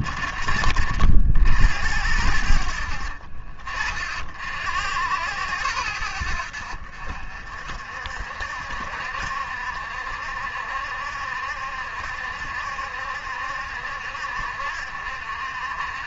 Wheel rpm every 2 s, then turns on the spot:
50, 70, 60, 70, 70, 70, 70, 60.
none